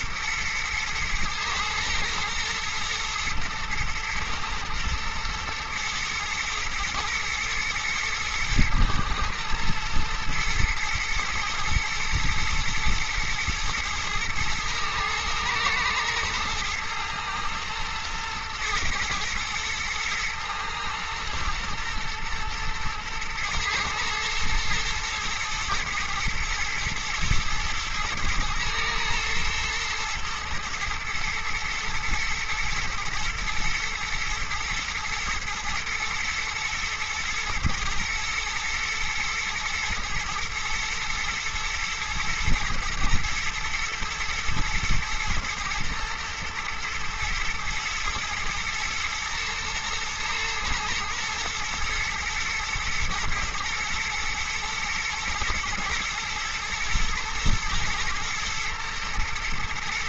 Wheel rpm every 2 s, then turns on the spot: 110, 110, 110, 110, 110, 110, 120, 110, 110, 110, 120, 110, 110, 120, 110, 110, 120, 120, 110, 110, 110, 120, 120, 110, 110, 110, 110, 110, 110, 110.
none